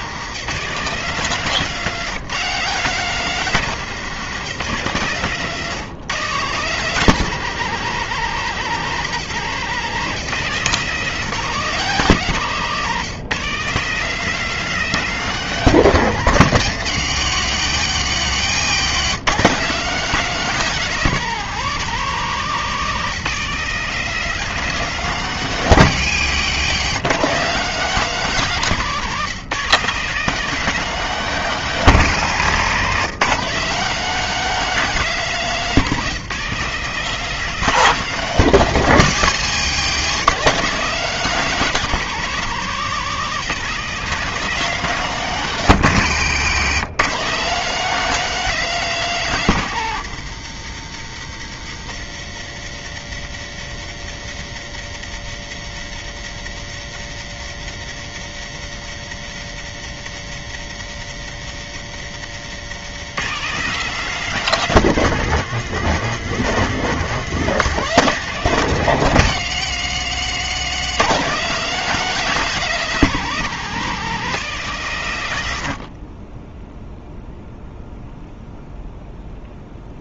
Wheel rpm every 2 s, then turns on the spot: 170, 190, 150, 170, 160, 170, 160, 210, 150, 140, 200, 180, 200, 150, 180, 210, 160, 210, 190, 180, 190, 190, 190, 160, 210, 130, 120, 120, 120, 120, 120, 150, 190, 180, 160, 130, 200, 170, 0, 0.
18-20